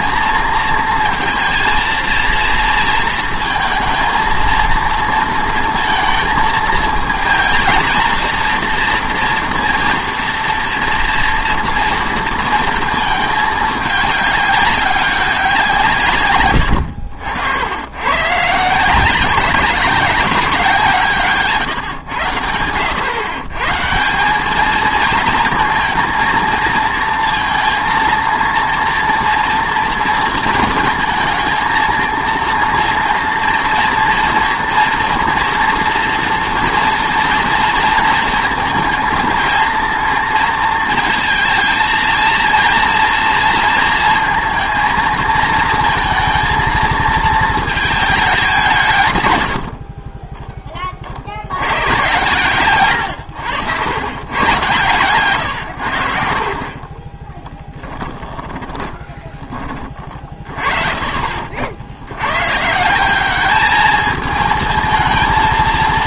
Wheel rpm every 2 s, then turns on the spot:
230, 230, 230, 220, 230, 230, 230, 200, 100, 150, 180, 100, 210, 230, 230, 230, 230, 230, 230, 230, 230, 230, 220, 230, 180, 10, 120, 130, 40, 20, 50, 140, 220.
58-60